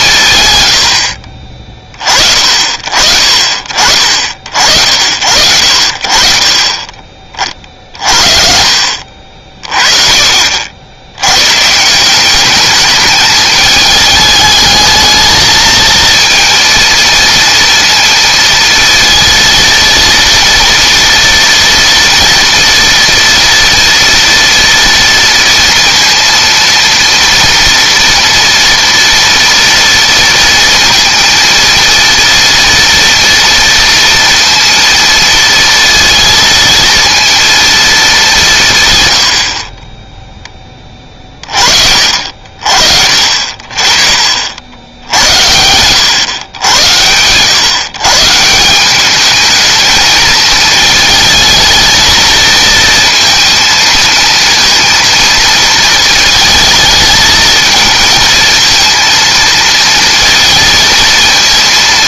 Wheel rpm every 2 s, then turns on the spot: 110, 50, 60, 30, 50, 60, 200, 220, 230, 230, 230, 230, 230, 230, 230, 230, 230, 230, 230, 140, 20, 50, 80, 100, 180, 220, 230, 230, 220, 230, 230.
none